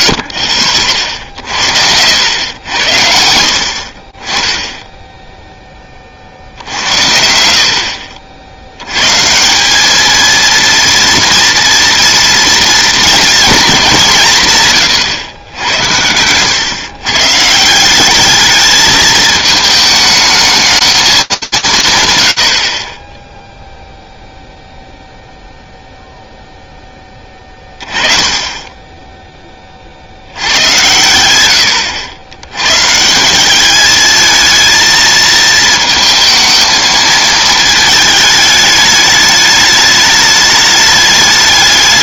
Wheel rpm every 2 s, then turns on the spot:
30, 80, 10, 70, 90, 230, 230, 130, 110, 220, 220, 50, 0, 10, 20, 100, 150, 220, 220, 210, 210.
0-2 14-16